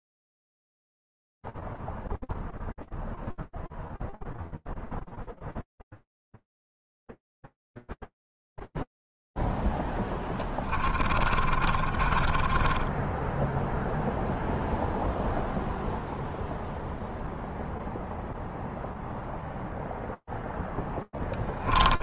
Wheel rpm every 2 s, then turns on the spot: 0, 0, 0, 0, 0, 30, 20, 0, 0, 0, 0.
10-14